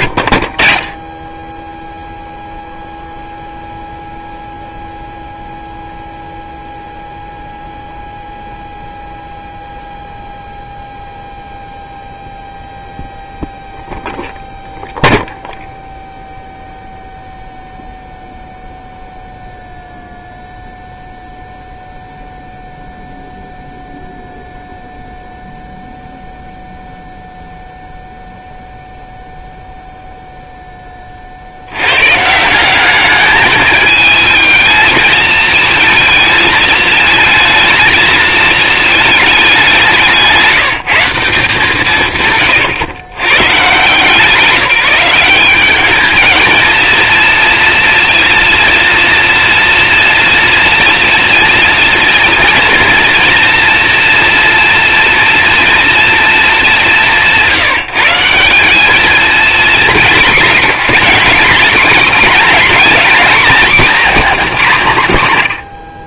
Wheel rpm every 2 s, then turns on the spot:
50, 0, 0, 0, 0, 0, 0, 0, 0, 0, 0, 0, 0, 0, 0, 10, 190, 220, 220, 230, 190, 110, 180, 230, 230, 230, 230, 230, 200, 180, 220, 230, 210.
none